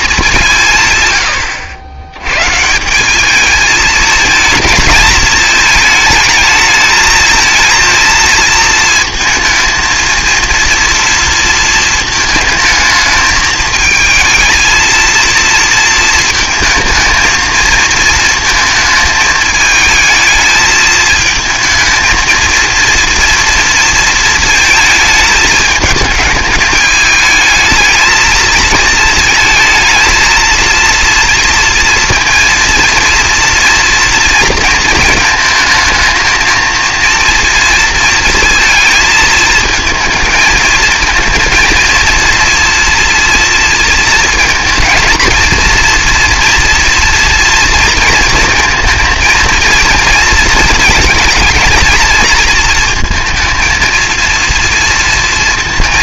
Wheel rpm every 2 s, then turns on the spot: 150, 140, 220, 210, 230, 230, 220, 230, 230, 220, 220, 230, 220, 210, 220, 230, 230, 230, 220, 230, 220, 230, 230, 230, 230, 220, 230, 230.
none